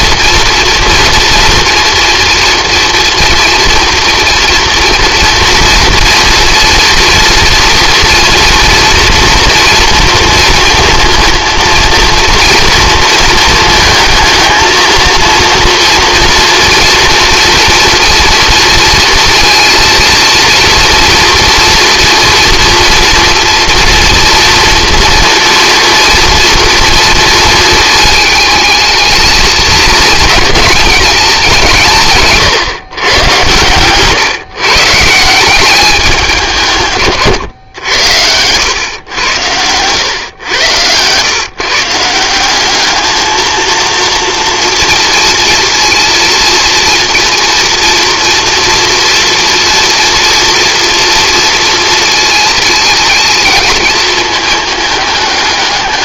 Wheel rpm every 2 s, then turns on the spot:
230, 240, 240, 230, 230, 230, 230, 230, 240, 230, 230, 230, 230, 230, 220, 210, 120, 140, 140, 100, 110, 210, 230, 230, 240, 230, 220, 210.
none